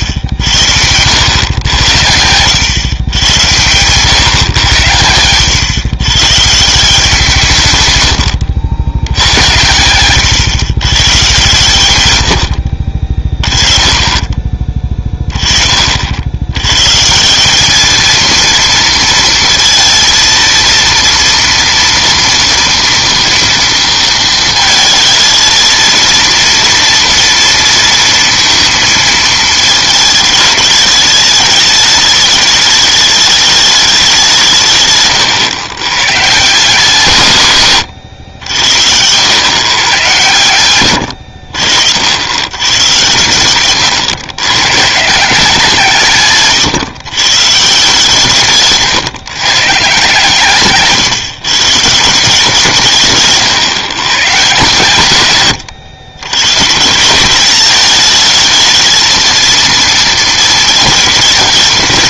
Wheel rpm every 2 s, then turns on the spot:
80, 100, 120, 150, 90, 120, 70, 20, 110, 230, 230, 230, 220, 230, 230, 210, 210, 150, 160, 90, 120, 110, 110, 140, 150, 140, 170, 130, 140, 220, 220.
none